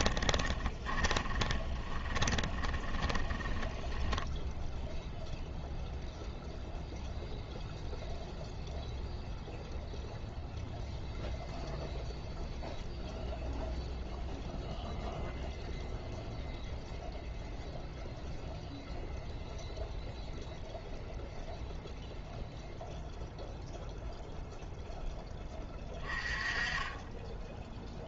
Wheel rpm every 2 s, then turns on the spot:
20, 20, 0, 0, 0, 0, 0, 0, 0, 0, 0, 0, 0, 20.
0-4